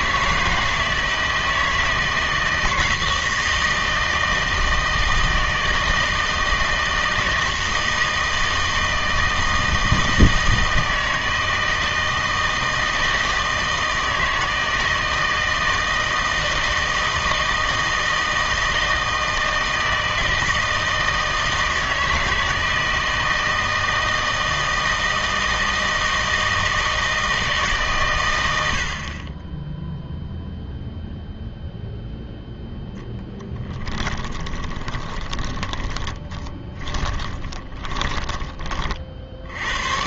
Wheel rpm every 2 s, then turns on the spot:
160, 160, 160, 160, 160, 160, 160, 160, 160, 160, 160, 160, 160, 160, 80, 0, 0, 20, 20, 30.
34-38